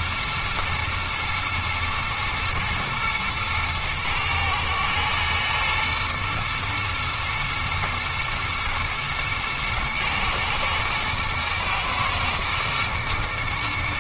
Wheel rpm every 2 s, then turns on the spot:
110, 110, 110, 120, 120, 110, 110.
none